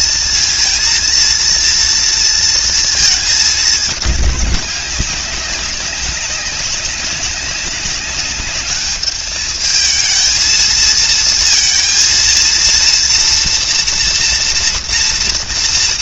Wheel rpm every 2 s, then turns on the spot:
230, 230, 200, 200, 210, 220, 230, 230.
none